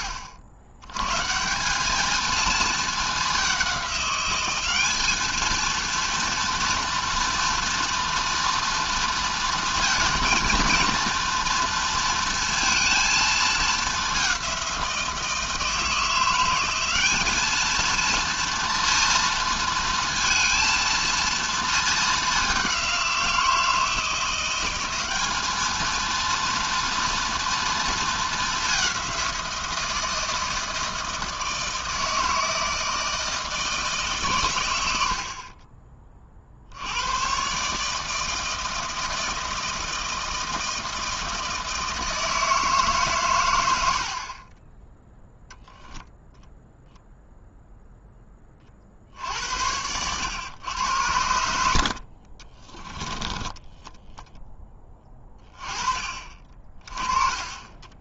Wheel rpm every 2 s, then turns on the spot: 90, 210, 210, 230, 230, 230, 230, 170, 190, 230, 230, 190, 190, 230, 200, 160, 160, 100, 60, 160, 160, 160, 30, 0, 30, 110, 20, 10, 30.
52-54 56-58